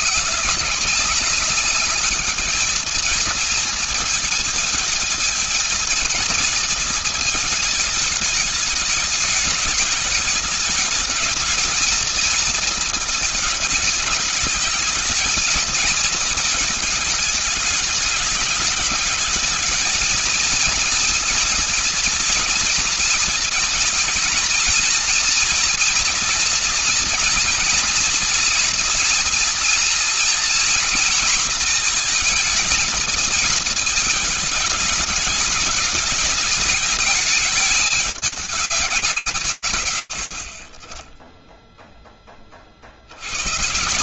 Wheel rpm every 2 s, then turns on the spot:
190, 220, 220, 220, 210, 210, 230, 210, 220, 210, 230, 240, 230, 230, 230, 230, 230, 210, 220, 200, 60, 40.
none